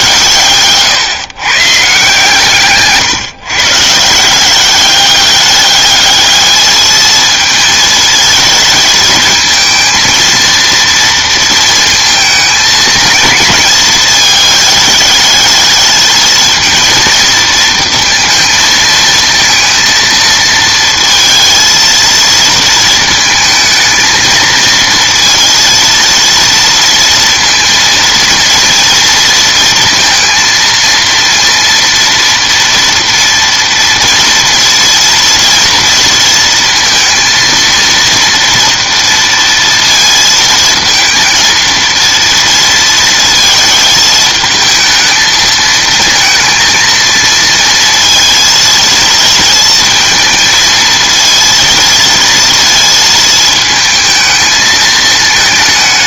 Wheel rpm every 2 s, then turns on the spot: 140, 140, 190, 220, 220, 230, 220, 210, 230, 220, 230, 220, 230, 230, 230, 230, 230, 230, 230, 230, 220, 230, 220, 230, 230, 230, 230, 220.
none